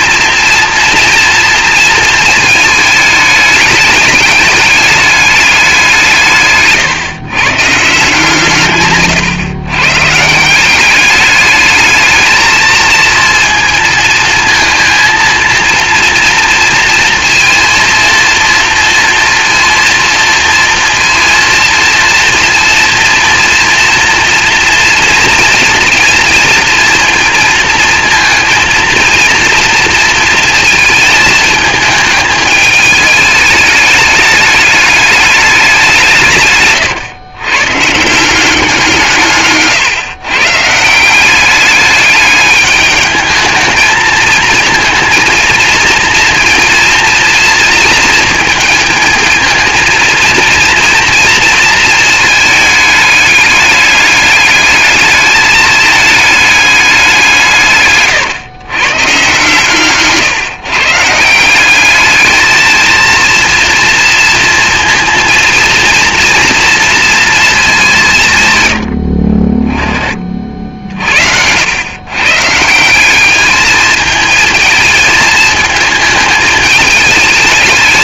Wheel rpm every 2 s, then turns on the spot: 230, 210, 210, 130, 130, 200, 220, 230, 230, 230, 230, 230, 230, 230, 230, 220, 210, 210, 120, 170, 170, 210, 230, 230, 220, 230, 210, 210, 190, 130, 150, 230, 230, 230, 60, 60, 190, 220, 210.
none